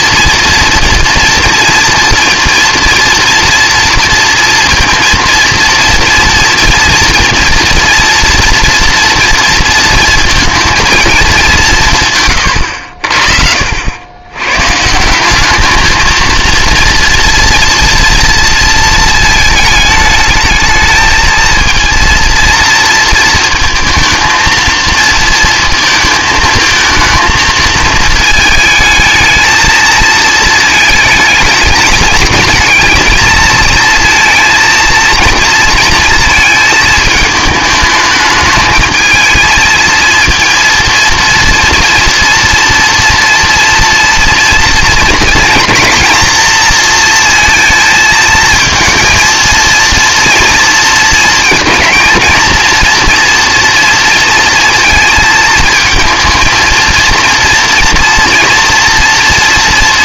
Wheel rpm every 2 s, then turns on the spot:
230, 230, 230, 230, 230, 230, 90, 140, 230, 230, 220, 230, 230, 230, 220, 220, 220, 230, 220, 220, 230, 230, 230, 230, 230, 230, 230, 230, 230, 230.
none